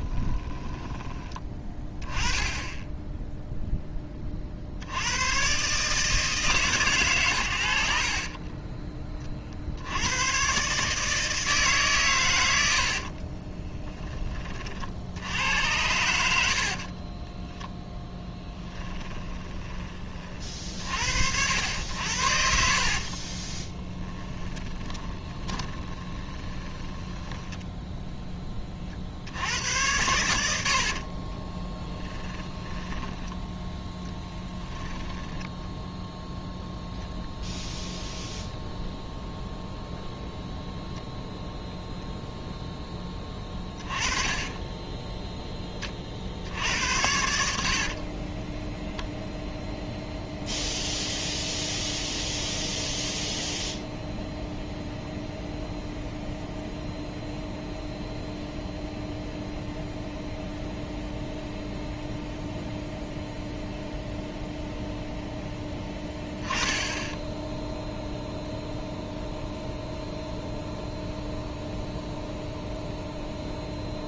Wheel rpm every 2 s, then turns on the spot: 20, 10, 70, 130, 20, 140, 70, 60, 50, 20, 60, 50, 30, 10, 40, 60, 10, 10, 0, 0, 0, 10, 10, 80, 0, 0, 0, 0, 0, 0, 0, 0, 0, 20, 0, 0, 0.
0-4 12-14 16-20 22-28 30-36 44-46